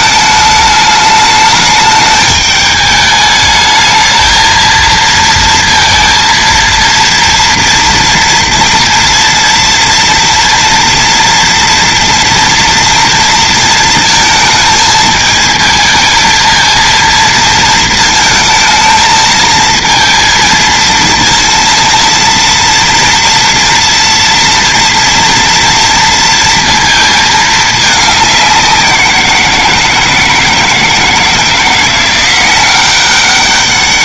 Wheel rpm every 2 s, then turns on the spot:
210, 210, 230, 230, 230, 230, 230, 220, 230, 220, 230, 230, 230, 230, 180, 160, 200.
none